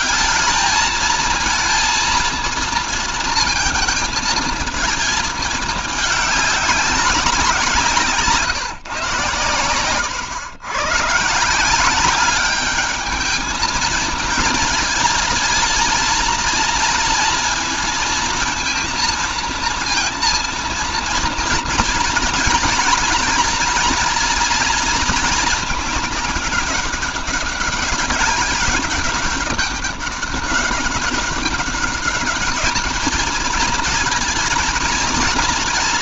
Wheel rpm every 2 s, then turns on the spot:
220, 230, 220, 200, 140, 120, 210, 220, 230, 230, 230, 240, 230, 200, 200, 200, 210, 230.
none